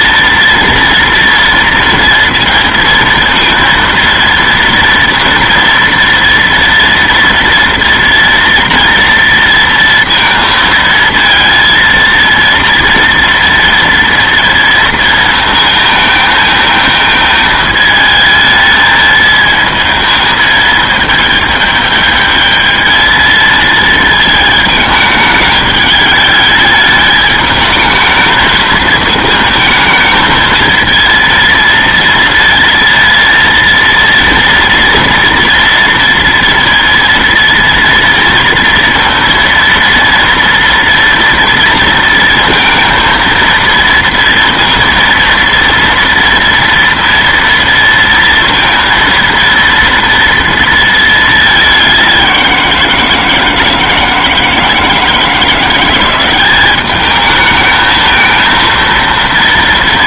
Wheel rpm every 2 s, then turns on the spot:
230, 230, 230, 230, 240, 230, 230, 230, 220, 220, 220, 210, 220, 210, 220, 220, 230, 230, 230, 230, 230, 230, 230, 230, 230, 230, 190, 160, 190, 220.
none